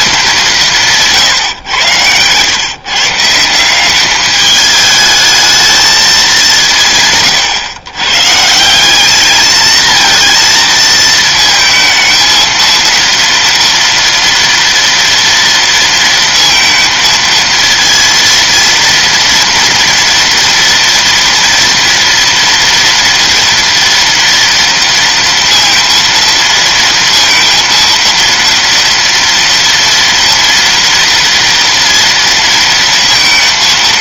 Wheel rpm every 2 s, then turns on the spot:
180, 130, 210, 170, 170, 230, 230, 240, 230, 230, 230, 230, 230, 230, 230, 230, 230.
none